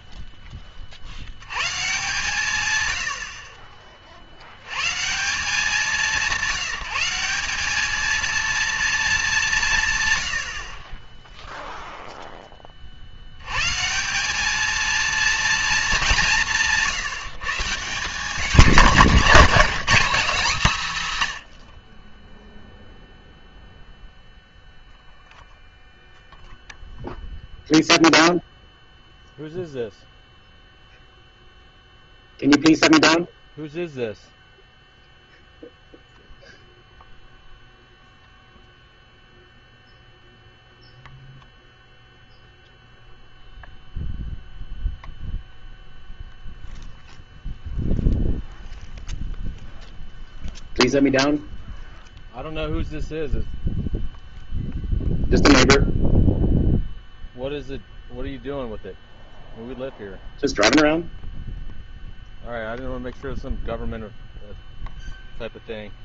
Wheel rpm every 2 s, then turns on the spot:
30, 130, 100, 180, 230, 40, 20, 220, 160, 210, 210, 0, 0, 0, 0, 0, 0, 0, 0, 0, 0, 0, 0, 0, 0, 0, 0, 0, 0, 0, 0, 0, 0.
none